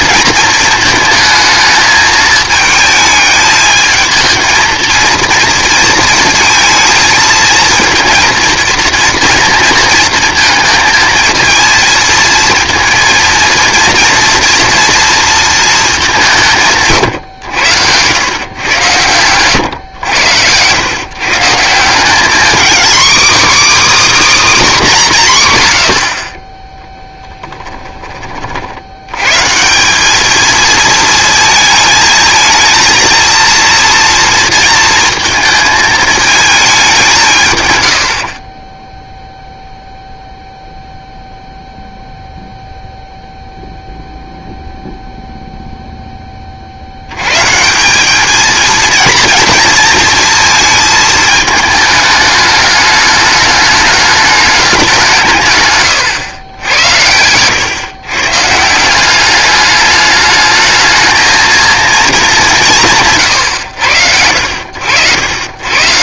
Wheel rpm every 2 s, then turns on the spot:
220, 220, 230, 220, 230, 230, 230, 230, 150, 110, 110, 260, 240, 10, 70, 220, 230, 230, 200, 10, 0, 0, 0, 50, 230, 230, 210, 190, 90, 160, 220, 210, 70.
none